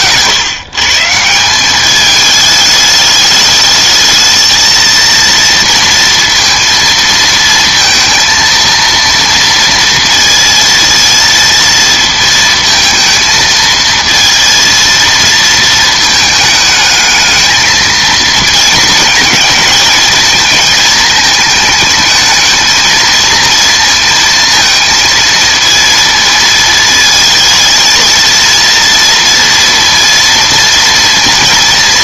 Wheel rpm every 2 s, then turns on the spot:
150, 210, 230, 230, 230, 230, 230, 230, 210, 220, 220, 220, 230, 220, 230, 230.
none